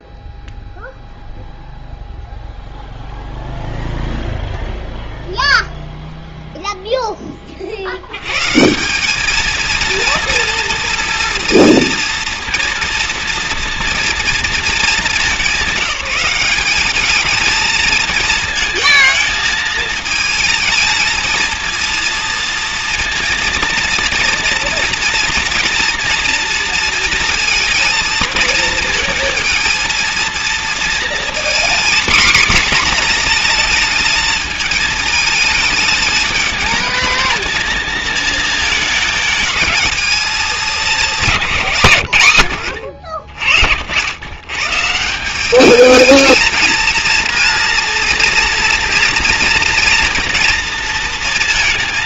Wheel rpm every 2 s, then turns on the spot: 0, 0, 0, 0, 140, 230, 230, 210, 200, 230, 230, 230, 230, 230, 220, 230, 240, 220, 210, 220, 210, 90, 150, 230, 230, 230.
none